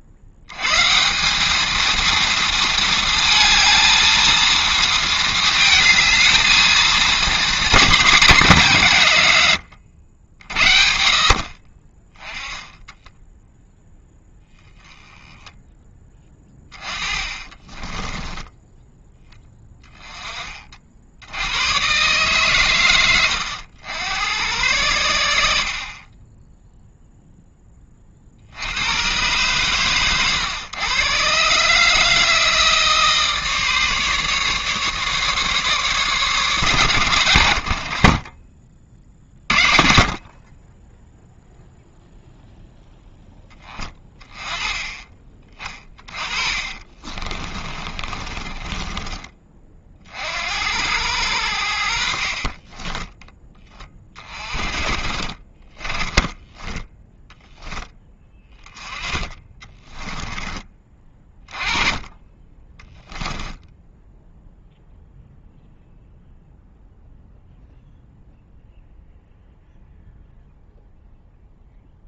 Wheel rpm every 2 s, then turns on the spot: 120, 230, 230, 220, 170, 60, 10, 10, 20, 10, 40, 120, 90, 0, 80, 120, 160, 150, 130, 40, 20, 0, 10, 30, 20, 80, 20, 30, 10, 20, 20, 10, 0, 0, 0, 0.
16-18 46-50 52-54 56-58